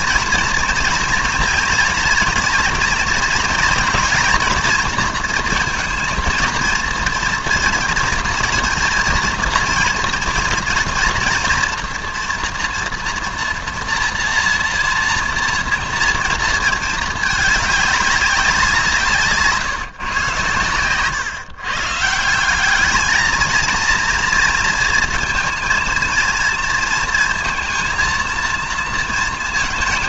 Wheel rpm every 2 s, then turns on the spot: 230, 230, 230, 230, 230, 230, 240, 230, 230, 180, 120, 190, 230, 230, 230.
none